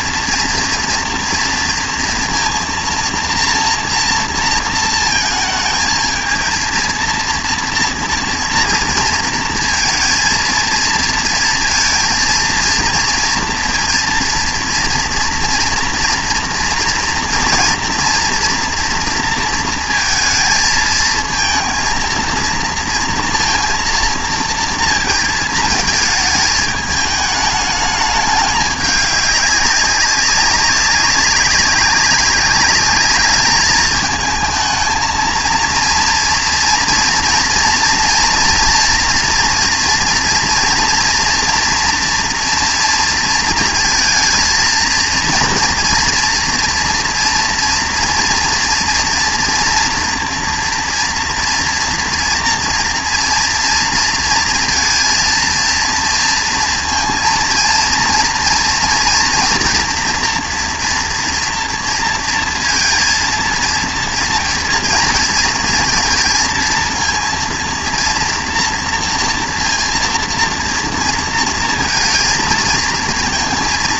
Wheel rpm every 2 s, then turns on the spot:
230, 230, 230, 230, 230, 220, 230, 230, 230, 230, 220, 230, 230, 220, 210, 190, 200, 220, 230, 230, 230, 230, 230, 240, 230, 230, 230, 230, 230, 230, 230, 230, 230, 230, 230, 230, 230.
none